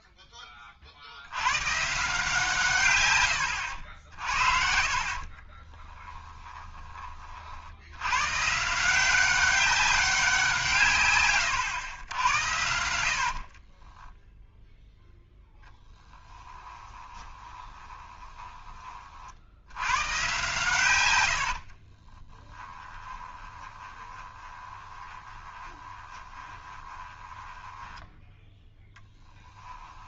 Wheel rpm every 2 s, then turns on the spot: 20, 140, 60, 20, 150, 170, 70, 0, 20, 20, 130, 20, 20, 20, 10.
4-8 16-18 22-28